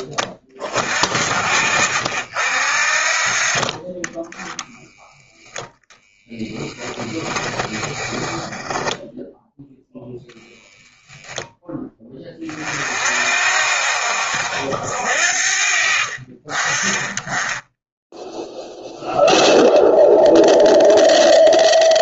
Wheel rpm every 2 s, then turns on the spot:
50, 40, 0, 10, 10, 10, 50, 60, 10, 0, 0.
6-8